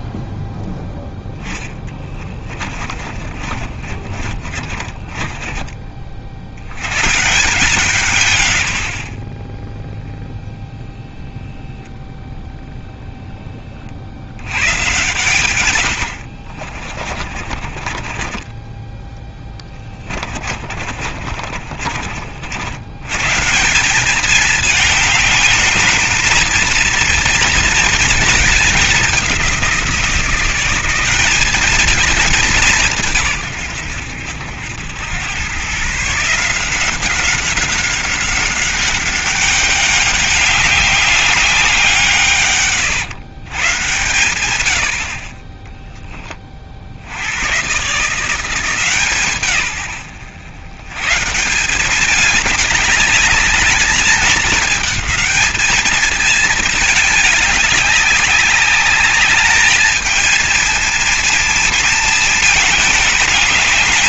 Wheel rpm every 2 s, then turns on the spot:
10, 30, 40, 90, 110, 0, 0, 120, 50, 10, 40, 80, 210, 230, 210, 190, 190, 90, 180, 190, 200, 120, 90, 50, 170, 110, 200, 210, 210, 200, 220, 210.
2-6 16-22